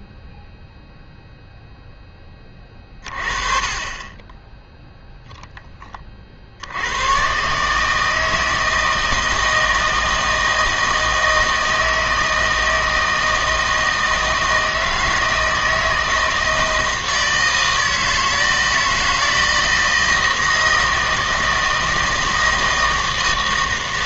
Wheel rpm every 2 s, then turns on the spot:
0, 30, 0, 70, 160, 160, 160, 160, 160, 160, 160, 160.
none